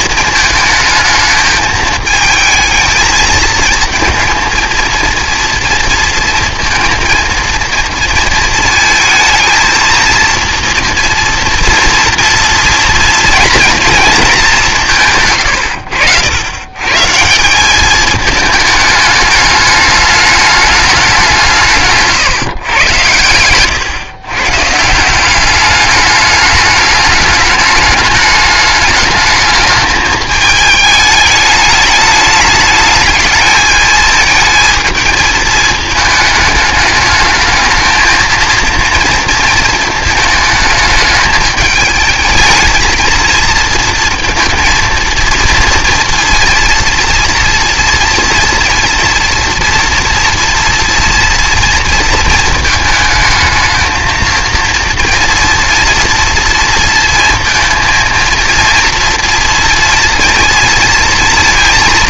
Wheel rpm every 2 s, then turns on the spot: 220, 220, 230, 230, 230, 230, 230, 190, 120, 210, 210, 130, 140, 210, 210, 210, 220, 220, 210, 230, 220, 220, 230, 230, 240, 230, 220, 230, 230, 230, 230.
none